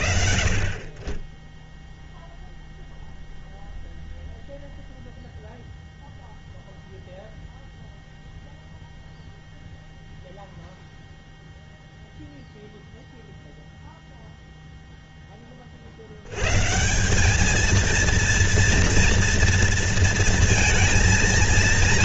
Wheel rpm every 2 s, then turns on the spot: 30, 0, 0, 0, 0, 0, 0, 0, 160, 230, 230.
none